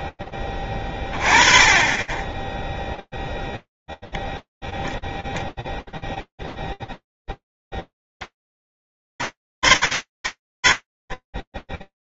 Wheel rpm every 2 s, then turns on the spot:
0, 30, 0, 0, 80, 20.
none